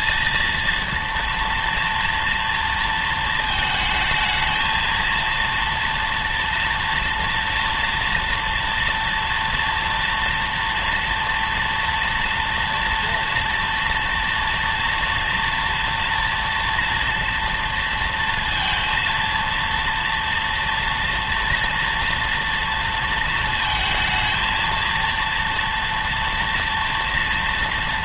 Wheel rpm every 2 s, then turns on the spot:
230, 230, 220, 230, 230, 230, 240, 230, 230, 230, 230, 230, 230, 230.
none